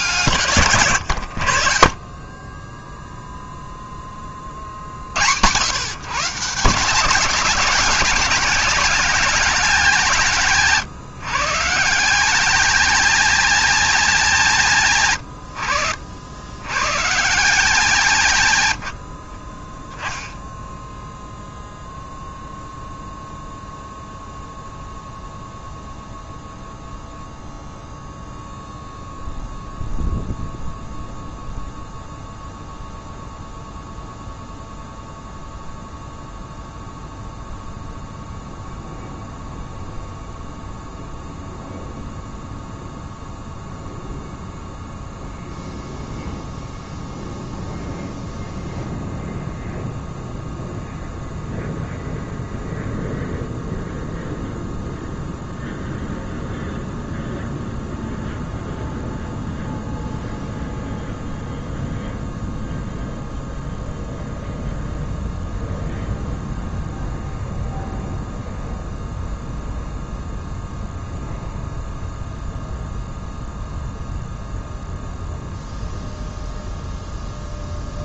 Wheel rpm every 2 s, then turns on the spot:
110, 10, 30, 170, 220, 150, 220, 170, 120, 100, 10, 0, 0, 0, 0, 0, 0, 0, 0, 0, 0, 0, 0, 0, 0, 0, 0, 0, 0, 0, 0, 0, 0, 0, 0, 0, 0, 0, 0.
none